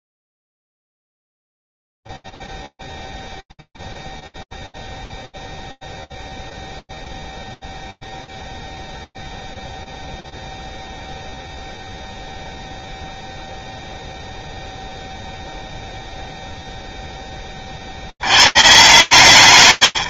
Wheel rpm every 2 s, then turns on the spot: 0, 0, 0, 0, 0, 0, 0, 0, 30, 150.
none